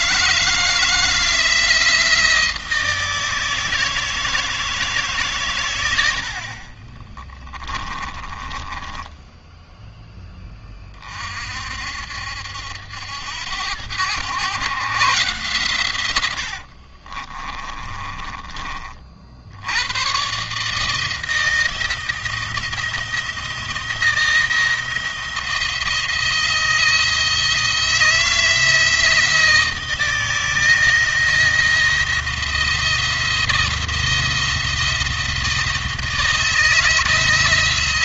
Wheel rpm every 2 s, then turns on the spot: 160, 160, 150, 40, 10, 30, 80, 130, 50, 40, 160, 160, 170, 160, 160, 170, 170, 170, 160.
6-10 16-18